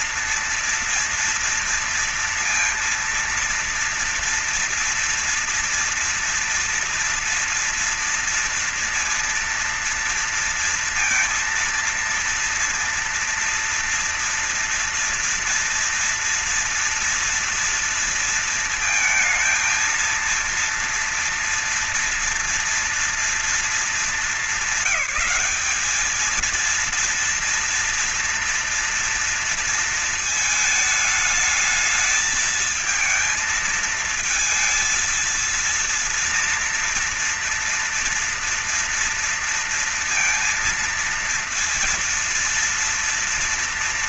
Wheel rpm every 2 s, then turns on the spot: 230, 230, 230, 230, 230, 230, 230, 230, 230, 230, 230, 230, 220, 230, 230, 220, 220, 230, 230, 230, 230, 230.
none